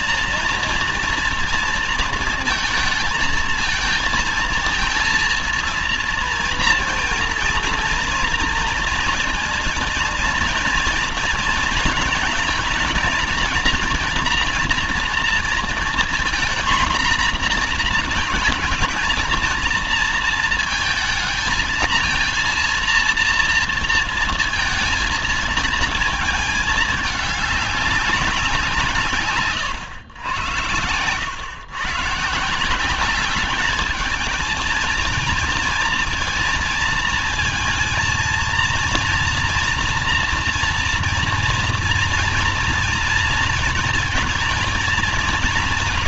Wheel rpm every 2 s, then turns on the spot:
230, 220, 230, 230, 230, 230, 230, 230, 230, 230, 230, 230, 220, 210, 160, 90, 180, 220, 230, 230, 230, 230, 230.
none